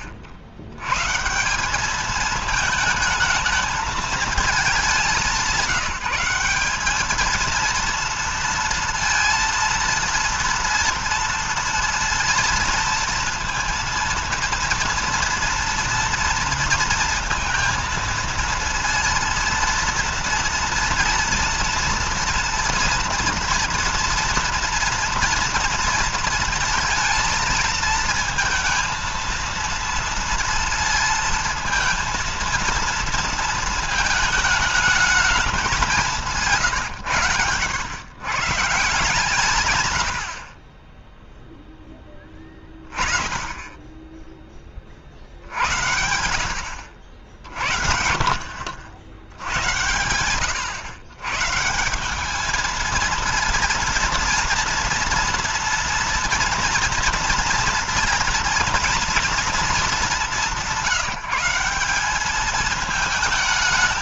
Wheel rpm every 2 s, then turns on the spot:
100, 220, 210, 200, 230, 230, 230, 230, 230, 230, 230, 230, 230, 230, 230, 230, 230, 220, 140, 150, 50, 20, 30, 70, 60, 110, 220, 230, 230, 230, 180, 210.
none